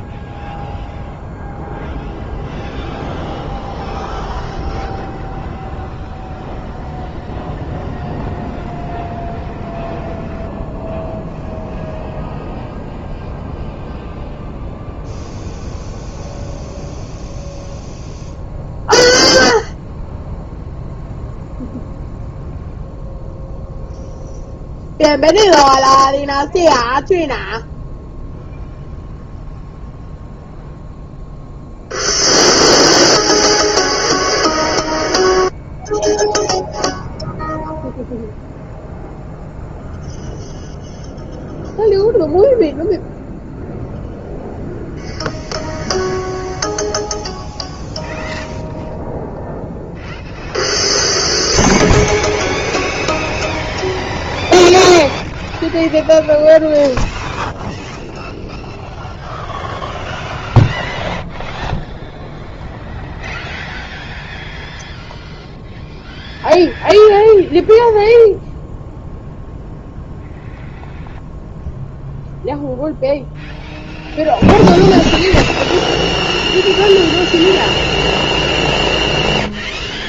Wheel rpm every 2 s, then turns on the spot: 0, 0, 0, 0, 0, 0, 0, 0, 0, 0, 0, 0, 0, 0, 0, 0, 0, 0, 0, 0, 0, 0, 0, 0, 0, 0, 0, 0, 0, 0, 0, 0, 0, 0, 0, 0, 0, 0, 0, 0.
none